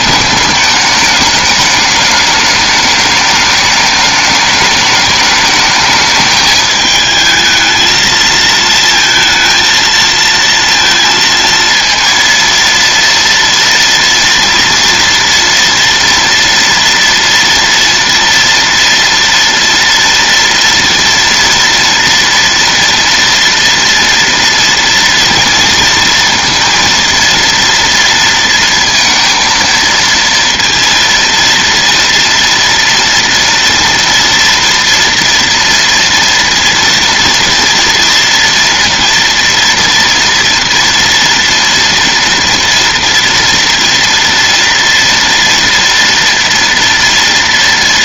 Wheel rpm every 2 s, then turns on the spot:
210, 210, 210, 210, 230, 230, 230, 240, 230, 230, 230, 240, 230, 230, 230, 230, 230, 230, 230, 230, 230, 240, 230, 230.
none